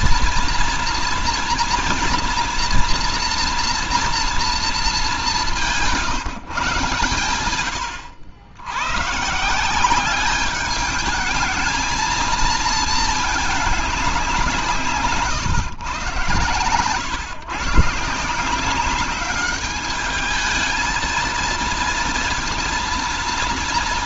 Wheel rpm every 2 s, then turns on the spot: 240, 240, 230, 150, 110, 210, 230, 160, 120, 180, 220, 230.
none